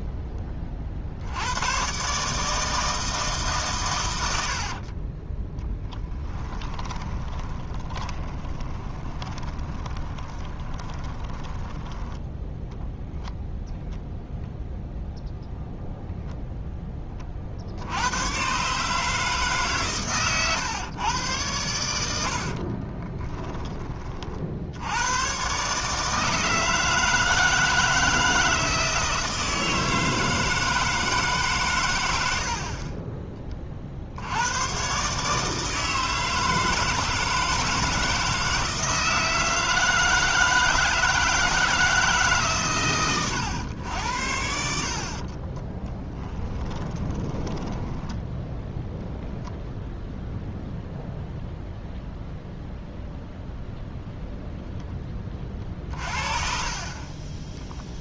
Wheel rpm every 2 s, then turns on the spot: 20, 160, 50, 20, 20, 20, 10, 0, 0, 130, 120, 40, 80, 160, 160, 160, 50, 110, 160, 160, 160, 130, 60, 20, 0, 0, 0, 0, 40.
4-12 22-24 46-48